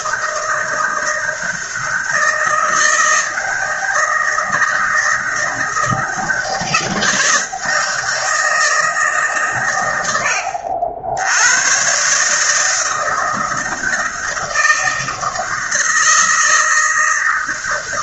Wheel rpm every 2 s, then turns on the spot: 160, 160, 160, 170, 150, 100, 160, 160, 160.
none